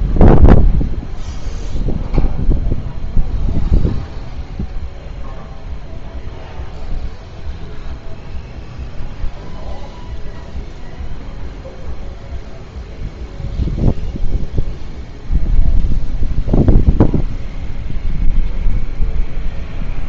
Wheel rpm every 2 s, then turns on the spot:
0, 0, 0, 0, 0, 0, 0, 0, 0, 0.
none